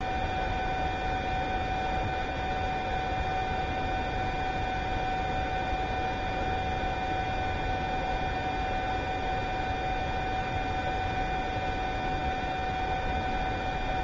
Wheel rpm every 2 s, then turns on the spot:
0, 0, 0, 0, 0, 0, 0.
none